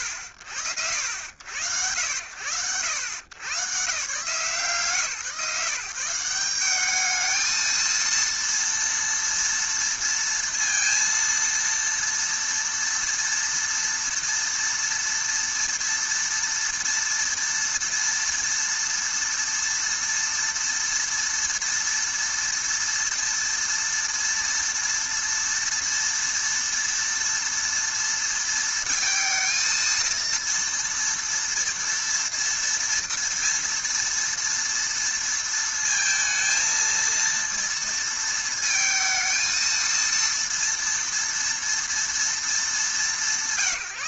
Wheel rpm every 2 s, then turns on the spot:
70, 110, 160, 220, 230, 230, 230, 230, 230, 230, 230, 230, 230, 230, 230, 230, 230, 230, 230, 230, 220, 110.
none